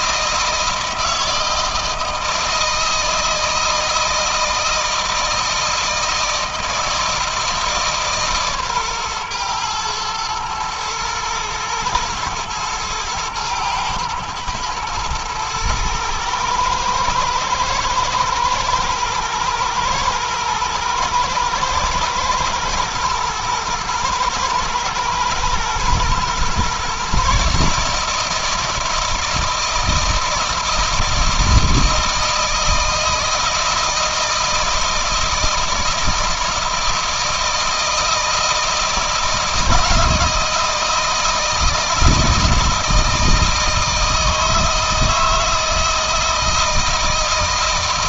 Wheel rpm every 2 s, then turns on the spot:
160, 160, 160, 160, 140, 110, 110, 110, 110, 120, 120, 110, 110, 130, 160, 160, 160, 170, 160, 160, 160, 160, 160, 160.
none